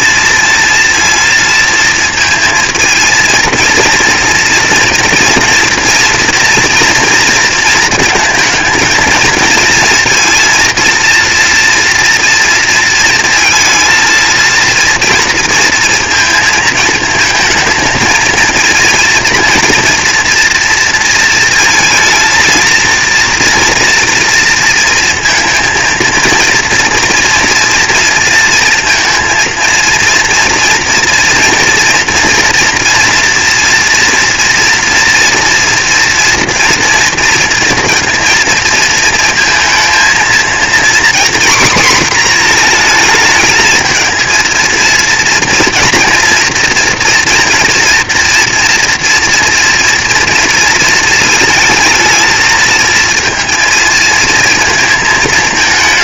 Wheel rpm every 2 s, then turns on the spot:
230, 220, 230, 230, 230, 230, 230, 230, 220, 230, 230, 230, 230, 230, 230, 230, 230, 240, 230, 230, 240, 230, 230, 230, 240, 230, 230, 220.
none